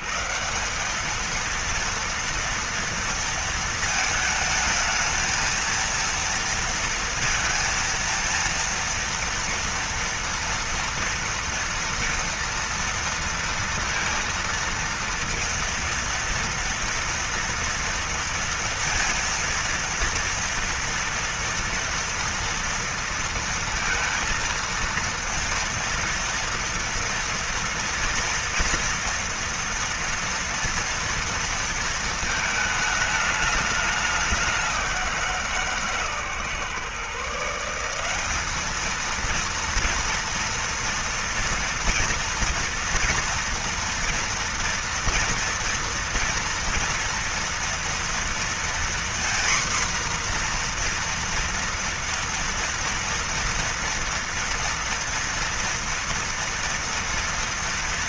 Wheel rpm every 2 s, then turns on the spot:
120, 230, 220, 230, 230, 230, 230, 230, 230, 230, 230, 230, 230, 230, 230, 230, 230, 200, 150, 180, 230, 230, 230, 230, 230, 240, 230, 230, 230.
none